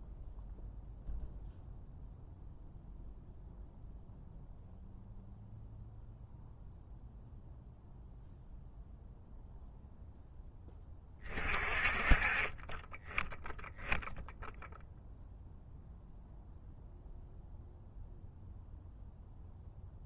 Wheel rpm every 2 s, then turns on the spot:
0, 0, 0, 0, 0, 20, 10, 0, 0, 0.
none